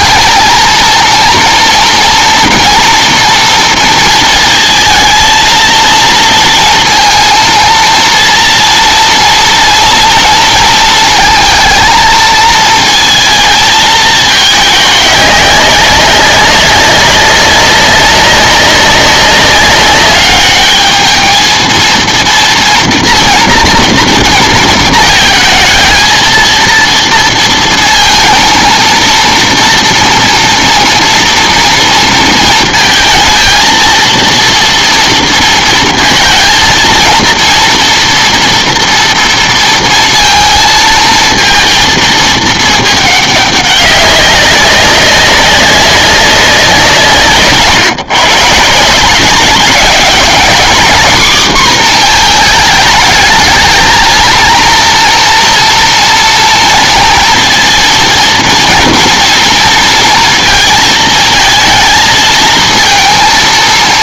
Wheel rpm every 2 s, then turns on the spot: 230, 230, 230, 230, 230, 230, 230, 210, 190, 200, 210, 230, 230, 230, 230, 230, 230, 230, 230, 230, 230, 220, 200, 180, 150, 230, 220, 230, 230, 230, 230, 230.
none